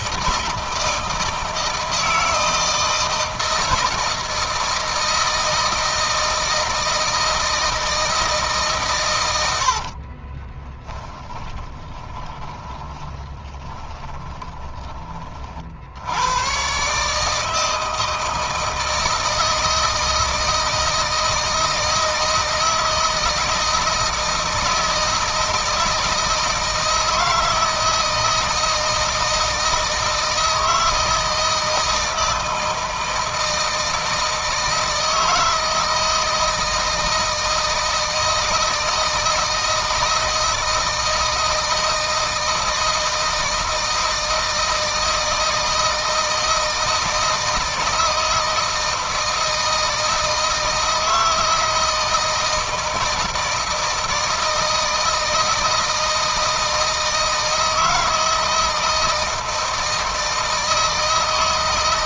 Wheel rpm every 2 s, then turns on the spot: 160, 170, 160, 160, 130, 20, 20, 30, 140, 160, 160, 160, 160, 160, 160, 160, 160, 160, 160, 160, 160, 160, 160, 160, 160, 160, 160, 160, 160, 160, 160.
10-14